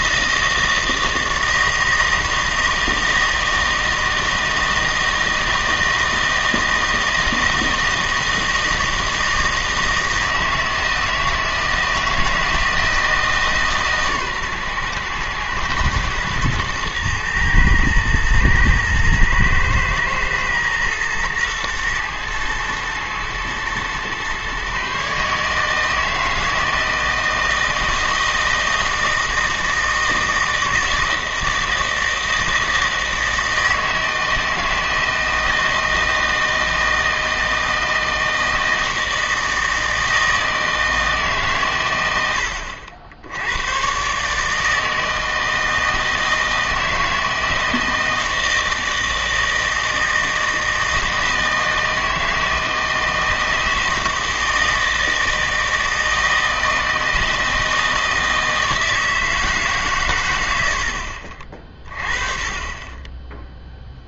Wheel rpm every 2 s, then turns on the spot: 160, 160, 160, 160, 160, 160, 160, 130, 110, 110, 110, 110, 130, 160, 160, 160, 160, 160, 160, 160, 160, 60, 160, 160, 160, 160, 160, 160, 160, 160, 70, 20.
none